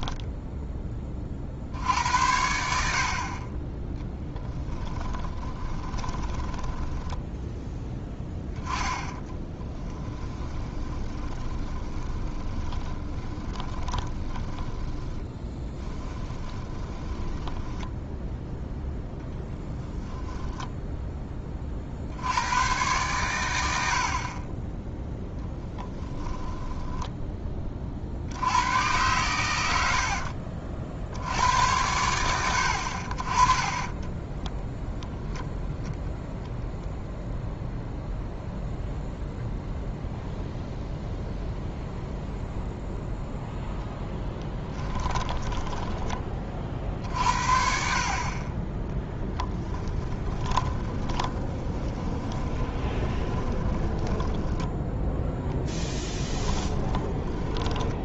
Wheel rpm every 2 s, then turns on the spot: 10, 70, 20, 10, 10, 20, 20, 10, 20, 0, 10, 110, 10, 10, 110, 70, 60, 0, 0, 0, 0, 0, 20, 40, 10, 30, 20, 10, 10.
4-8 10-18 44-46 50-54 56-58